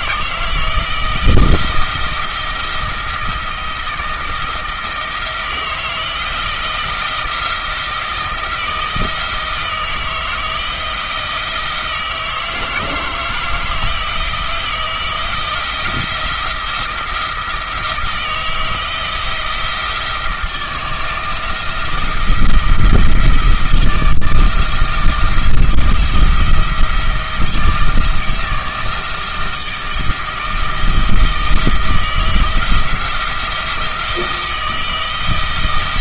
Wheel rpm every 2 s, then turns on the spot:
160, 160, 160, 170, 170, 160, 160, 160, 170, 160, 160, 160, 160, 170, 160, 160, 170, 160.
none